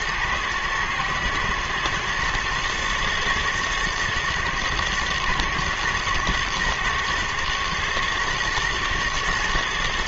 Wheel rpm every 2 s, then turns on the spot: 110, 120, 120, 120, 120.
none